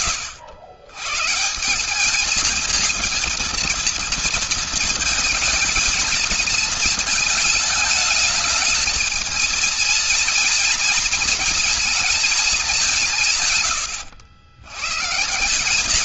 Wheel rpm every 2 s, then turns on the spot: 120, 220, 220, 220, 220, 230, 210, 80.
none